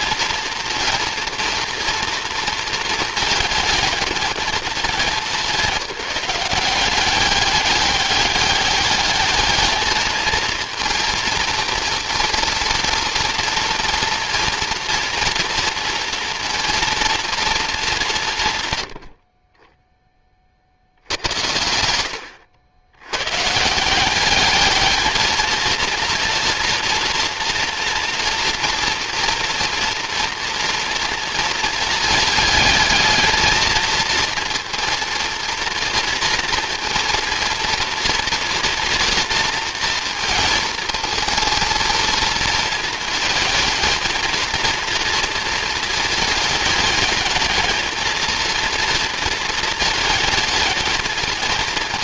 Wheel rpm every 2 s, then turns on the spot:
230, 230, 210, 190, 210, 230, 230, 230, 230, 100, 60, 100, 210, 230, 230, 240, 220, 230, 230, 240, 220, 230, 230, 210, 230, 220.
none